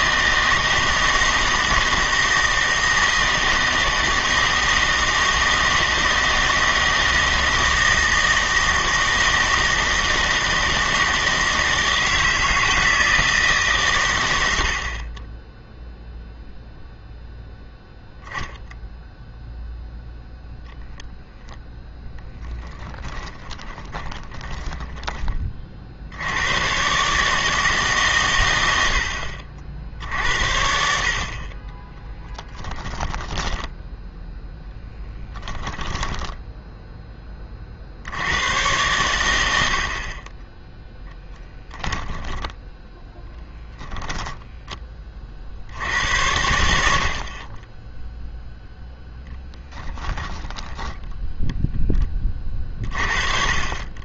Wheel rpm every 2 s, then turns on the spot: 160, 160, 160, 160, 160, 160, 160, 70, 0, 0, 0, 20, 20, 110, 90, 60, 10, 10, 10, 110, 10, 10, 10, 80, 0, 20, 40.
22-26 42-44 50-52